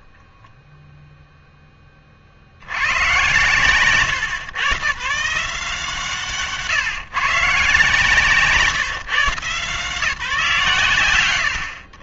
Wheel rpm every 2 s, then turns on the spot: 0, 80, 130, 150, 150, 140.
none